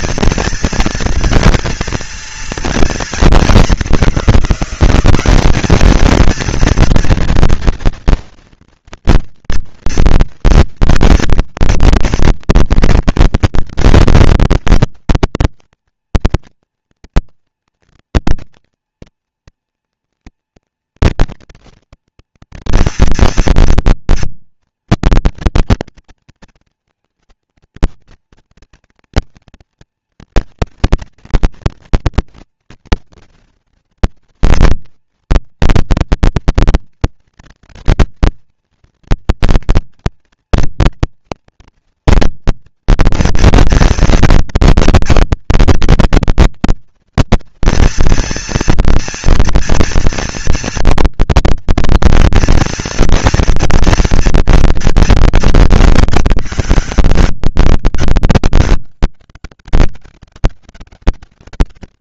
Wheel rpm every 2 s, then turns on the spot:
230, 240, 190, 230, 240, 230, 230, 230, 230, 230, 230, 230, 230, 230, 230, 230, 230, 230, 230, 230, 230, 240, 230, 230, 230, 240, 230, 230, 220, 200, 200.
none